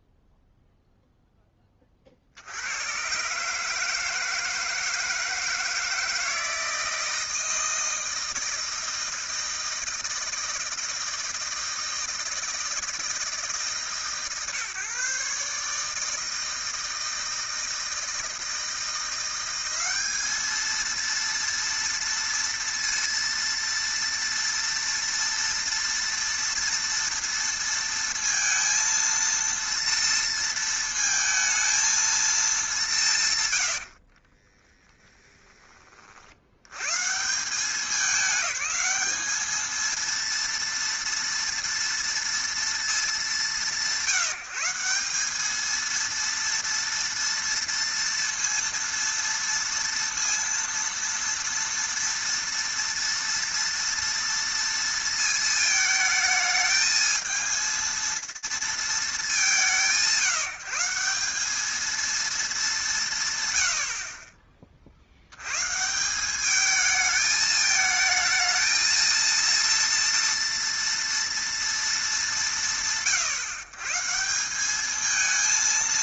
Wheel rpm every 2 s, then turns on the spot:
0, 70, 160, 160, 160, 170, 160, 130, 160, 160, 220, 230, 230, 230, 230, 230, 210, 20, 80, 200, 230, 230, 170, 230, 230, 230, 230, 230, 220, 200, 180, 170, 30, 210, 220, 230, 170, 210.
34-36